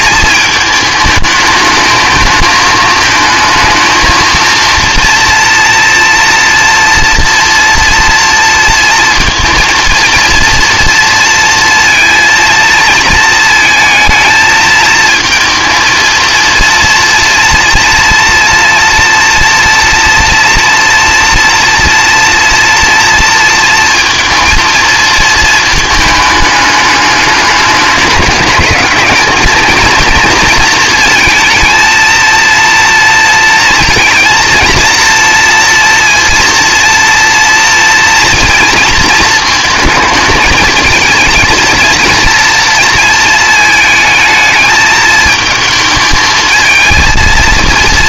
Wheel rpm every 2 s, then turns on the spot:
220, 220, 230, 230, 230, 230, 230, 220, 230, 230, 240, 230, 230, 210, 210, 230, 230, 230, 230, 230, 220, 230, 220, 220.
none